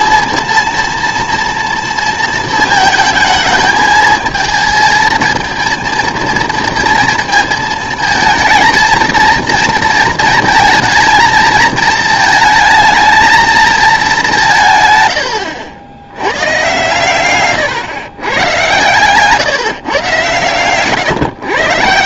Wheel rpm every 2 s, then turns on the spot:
230, 230, 220, 230, 220, 230, 220, 170, 110, 130, 120.
none